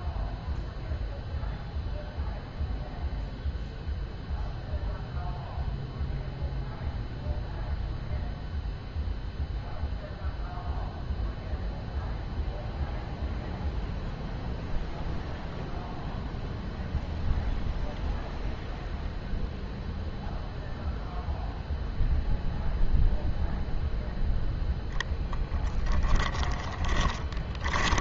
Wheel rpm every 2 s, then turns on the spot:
0, 0, 0, 0, 0, 0, 0, 0, 0, 0, 0, 0, 10, 20.
26-28